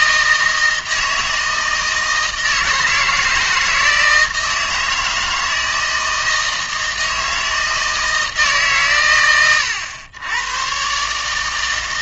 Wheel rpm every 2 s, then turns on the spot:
160, 160, 160, 160, 140, 120.
none